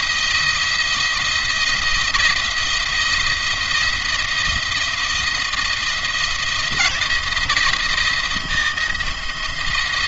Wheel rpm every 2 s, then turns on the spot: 170, 170, 170, 160, 170.
none